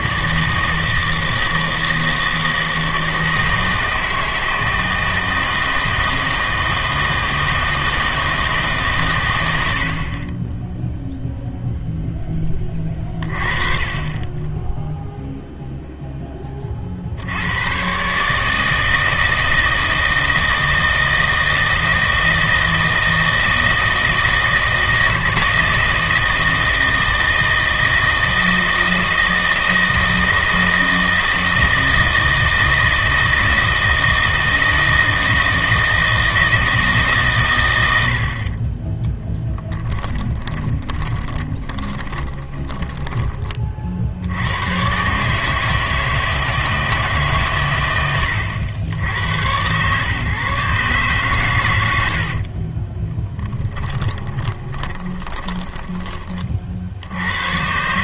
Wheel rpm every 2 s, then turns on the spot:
160, 160, 160, 160, 150, 10, 20, 10, 30, 160, 160, 160, 160, 160, 160, 160, 160, 160, 160, 40, 20, 20, 100, 160, 90, 140, 40, 20, 40.
40-44 52-56